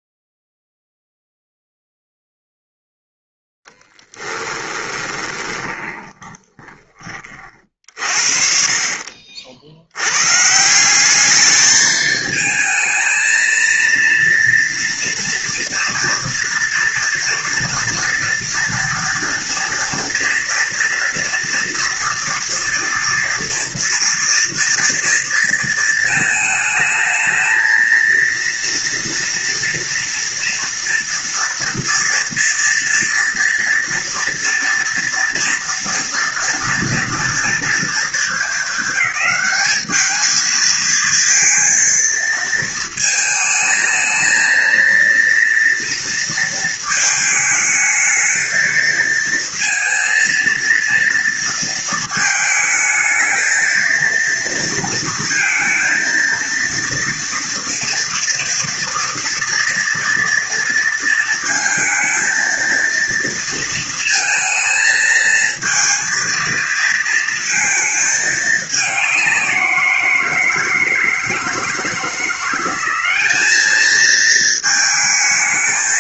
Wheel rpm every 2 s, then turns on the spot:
0, 0, 10, 20, 50, 150, 220, 230, 230, 230, 230, 240, 230, 220, 230, 230, 230, 230, 230, 200, 220, 220, 230, 230, 220, 230, 220, 230, 230, 230, 230, 230, 220, 230, 210, 160, 180, 220.
4-8